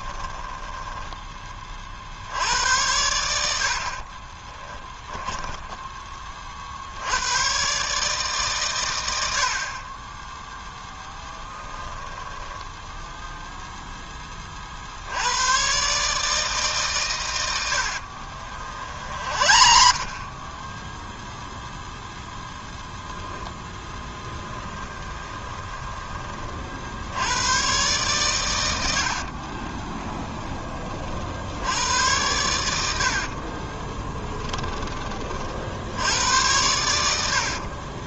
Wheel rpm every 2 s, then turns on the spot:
10, 80, 20, 60, 120, 0, 10, 50, 140, 60, 0, 10, 10, 50, 100, 40, 80, 20, 100.
0-2 4-6 12-14 18-20 24-26 32-34